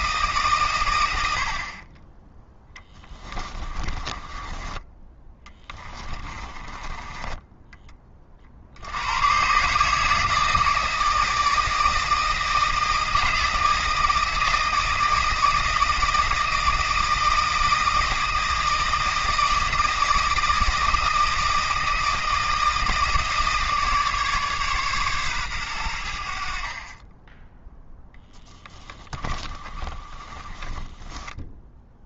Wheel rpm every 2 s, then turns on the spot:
110, 10, 20, 20, 80, 160, 160, 160, 160, 160, 160, 160, 140, 30, 20, 10.
2-8 28-32